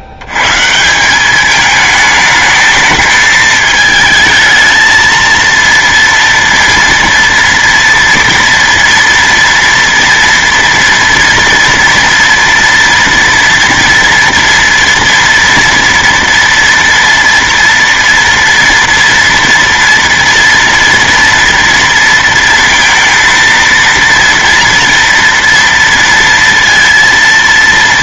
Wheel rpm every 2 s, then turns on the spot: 90, 220, 220, 230, 230, 230, 230, 230, 230, 230, 240, 230, 230, 230.
none